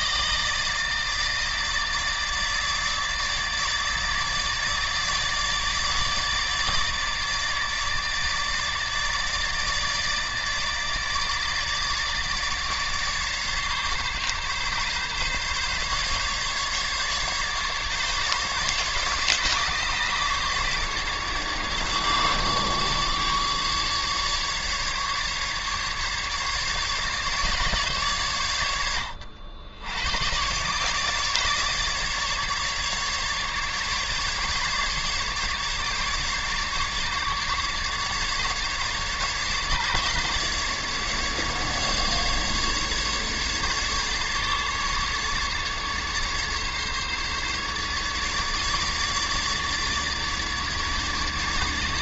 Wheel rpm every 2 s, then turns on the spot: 160, 150, 150, 150, 150, 150, 150, 140, 150, 150, 150, 150, 150, 150, 90, 140, 140, 140, 140, 140, 150, 150, 150, 140, 150, 150.
none